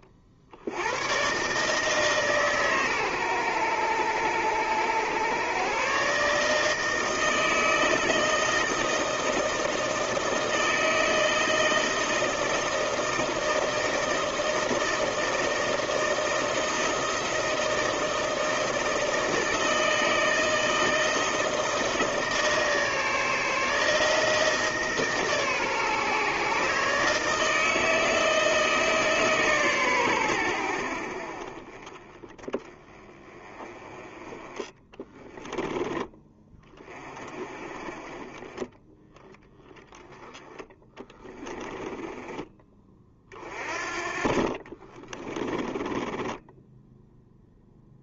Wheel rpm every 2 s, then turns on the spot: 50, 140, 110, 160, 160, 160, 160, 160, 160, 160, 160, 160, 160, 150, 160, 80, 20, 10, 20, 10, 10, 20, 30, 10.
34-36 40-42 44-48